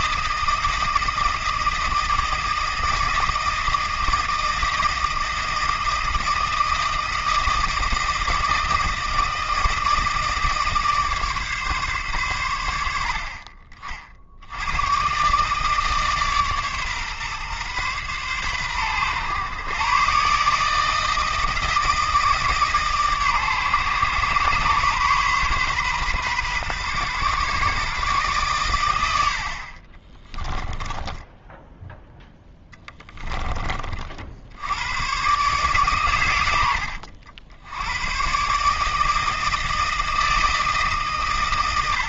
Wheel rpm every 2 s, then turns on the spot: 160, 160, 160, 160, 160, 150, 80, 110, 140, 120, 160, 150, 130, 130, 100, 10, 10, 100, 90, 150, 150.
30-34